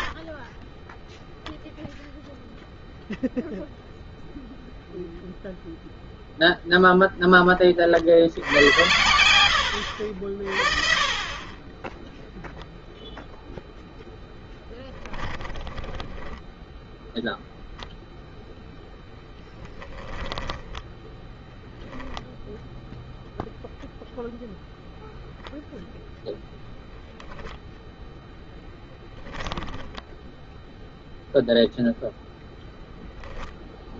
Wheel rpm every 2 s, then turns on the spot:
0, 0, 0, 70, 70, 10, 0, 10, 0, 10, 0, 0, 0, 0, 0, 0, 0.
10-12 14-16